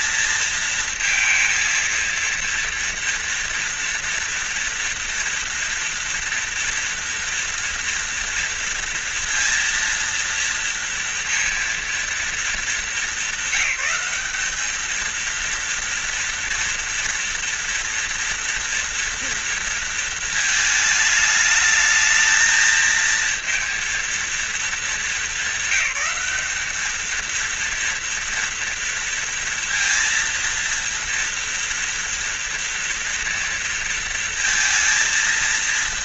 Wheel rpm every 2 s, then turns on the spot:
230, 230, 230, 230, 230, 230, 210, 210, 230, 230, 220, 220, 230, 220, 230, 230, 240, 230.
none